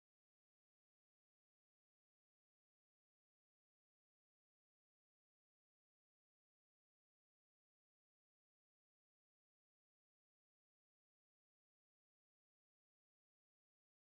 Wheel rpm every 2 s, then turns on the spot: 0, 0, 0, 0, 0, 0, 0.
none